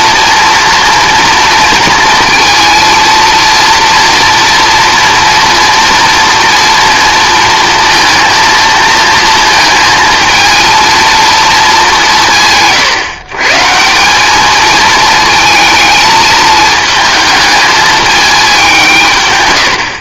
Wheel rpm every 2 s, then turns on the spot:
230, 220, 230, 230, 230, 230, 140, 220, 220, 180.
none